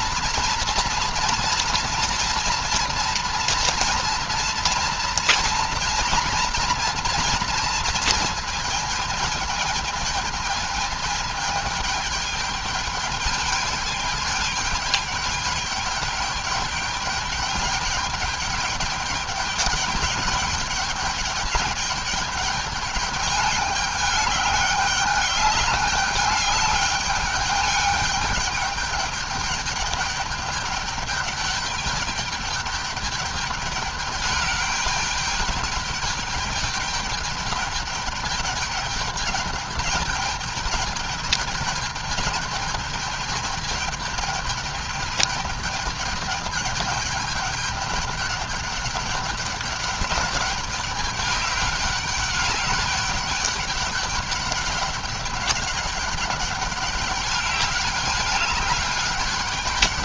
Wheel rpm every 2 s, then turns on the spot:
240, 240, 240, 240, 230, 220, 210, 210, 200, 210, 210, 210, 200, 210, 200, 200, 210, 210, 210, 210, 210, 210, 210, 210, 200, 200, 200, 200, 200, 200.
none